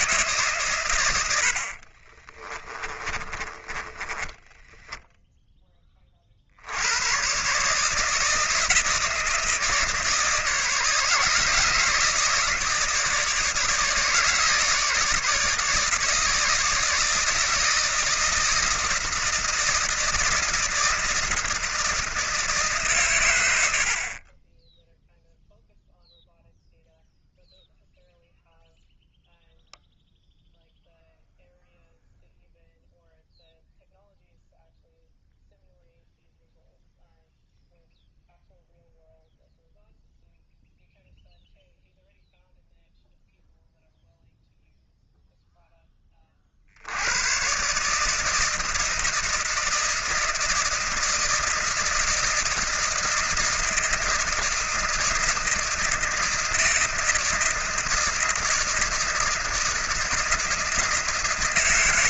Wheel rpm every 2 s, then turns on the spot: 130, 30, 10, 80, 160, 160, 160, 150, 160, 160, 160, 140, 10, 0, 0, 0, 0, 0, 0, 0, 0, 0, 0, 60, 160, 160, 160, 160, 160, 160, 160.
2-6